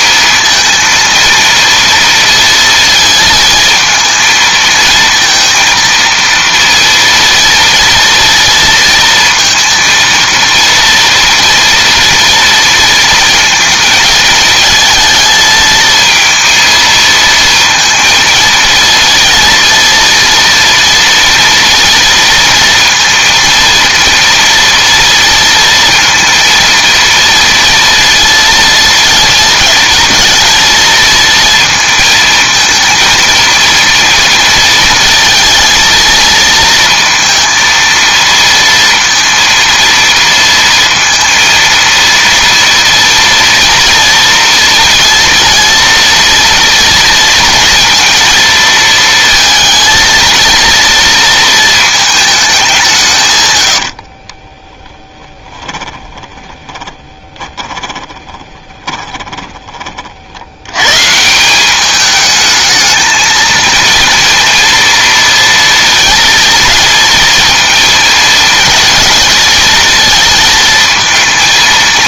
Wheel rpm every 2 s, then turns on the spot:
220, 230, 230, 230, 230, 230, 230, 220, 230, 230, 230, 230, 230, 230, 230, 230, 220, 230, 230, 230, 230, 230, 230, 230, 230, 230, 210, 30, 30, 20, 90, 220, 230, 230, 220, 230.
54-60